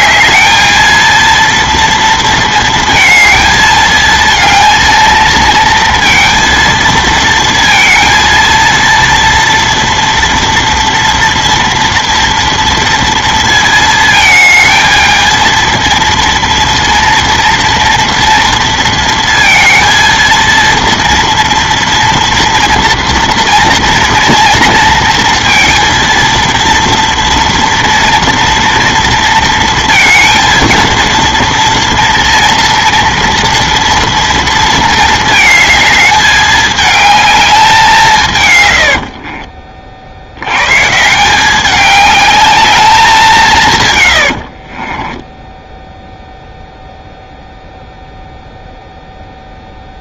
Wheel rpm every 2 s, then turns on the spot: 220, 230, 220, 230, 230, 230, 230, 220, 230, 230, 230, 230, 230, 230, 230, 230, 230, 230, 210, 110, 110, 210, 60, 0, 0.
44-46